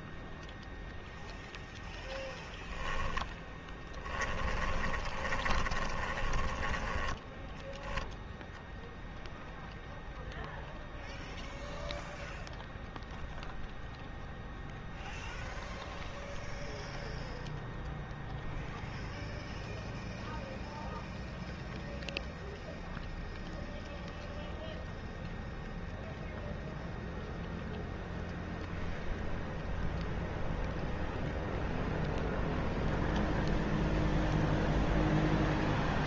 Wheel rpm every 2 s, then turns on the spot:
0, 0, 10, 10, 0, 0, 0, 0, 0, 0, 0, 0, 0, 0, 0, 0, 0, 0.
4-8